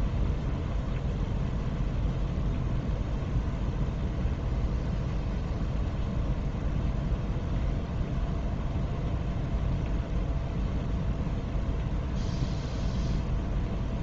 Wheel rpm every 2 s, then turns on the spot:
0, 0, 0, 0, 0, 0, 0.
none